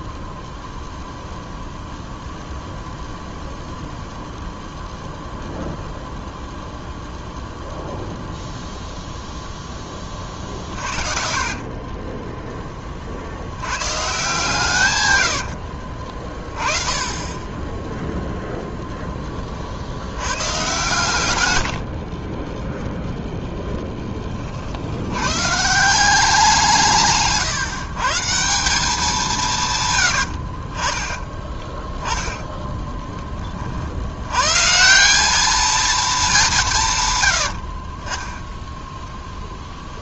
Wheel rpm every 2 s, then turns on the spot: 0, 0, 0, 0, 0, 40, 10, 140, 30, 0, 130, 10, 50, 180, 180, 50, 10, 150, 180, 10.
10-12 30-34 38-40